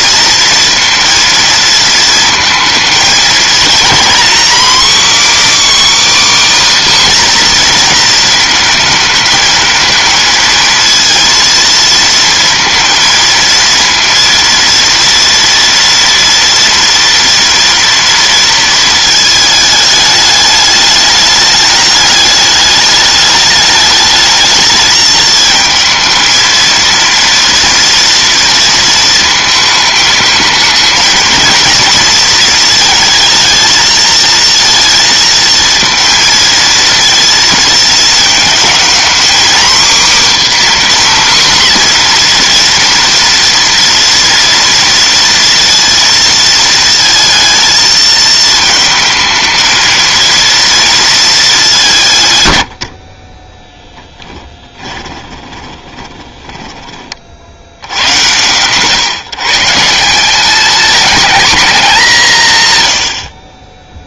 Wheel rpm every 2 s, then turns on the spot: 230, 230, 280, 280, 220, 230, 230, 230, 230, 230, 210, 210, 220, 230, 230, 220, 220, 230, 230, 230, 270, 240, 240, 230, 220, 230, 70, 20, 20, 120, 220, 110.
52-56